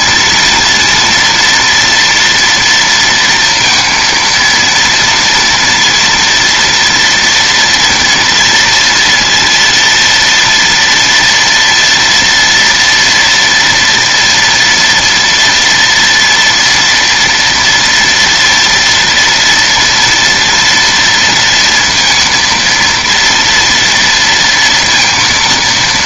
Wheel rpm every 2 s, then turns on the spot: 230, 230, 230, 230, 230, 230, 240, 230, 230, 230, 230, 230, 230.
none